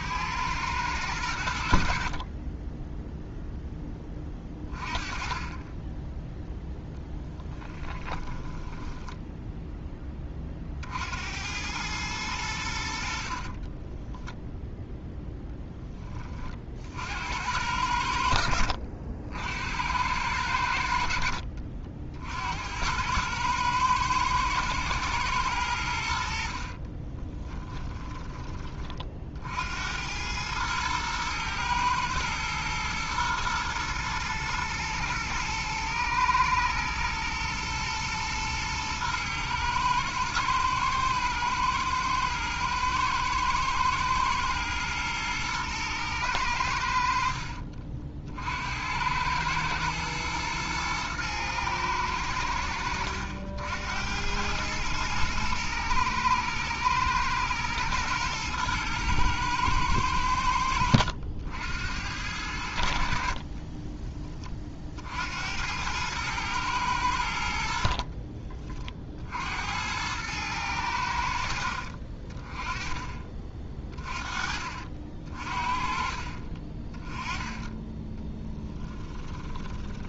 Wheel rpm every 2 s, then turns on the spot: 100, 10, 20, 0, 10, 50, 70, 10, 60, 70, 70, 90, 120, 40, 40, 110, 120, 110, 110, 110, 110, 110, 110, 70, 90, 110, 80, 110, 120, 110, 80, 60, 50, 100, 40, 80, 20, 50, 20, 10.
8-10 14-16 26-28 46-48 78-80